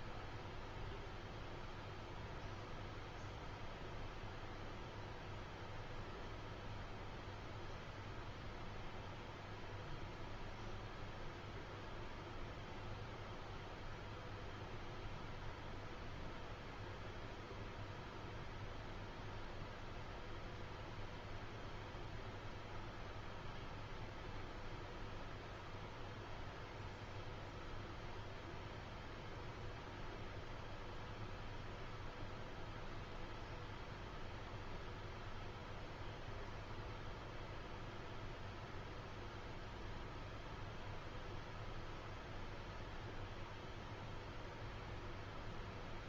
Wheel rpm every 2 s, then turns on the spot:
0, 0, 0, 0, 0, 0, 0, 0, 0, 0, 0, 0, 0, 0, 0, 0, 0, 0, 0, 0, 0, 0, 0.
none